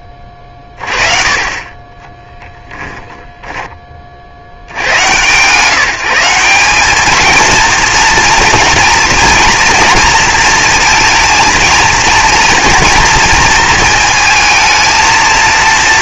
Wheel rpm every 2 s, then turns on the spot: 30, 10, 120, 220, 230, 230, 230, 220.
2-4